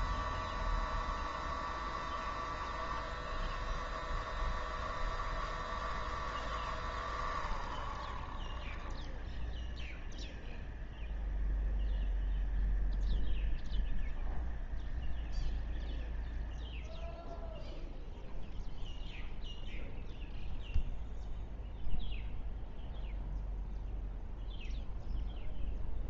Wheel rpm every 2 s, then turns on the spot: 0, 0, 0, 0, 0, 0, 0, 0, 0, 0, 0, 0, 0.
none